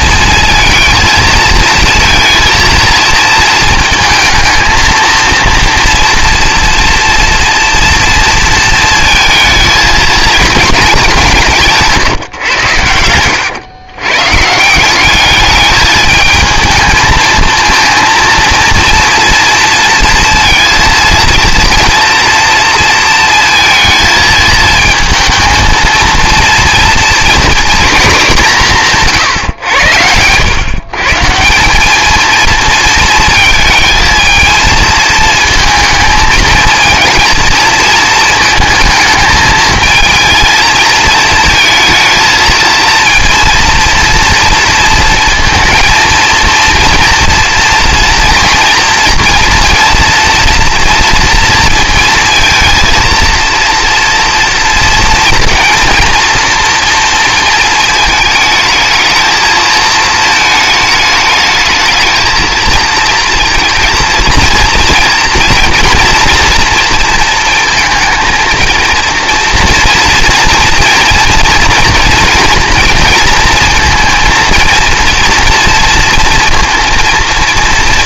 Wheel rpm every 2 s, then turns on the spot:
220, 230, 220, 230, 230, 220, 130, 150, 220, 230, 230, 230, 220, 230, 190, 110, 230, 220, 220, 220, 230, 230, 230, 230, 230, 230, 230, 230, 240, 220, 220, 220, 230, 230, 230, 230, 240, 230, 230.
none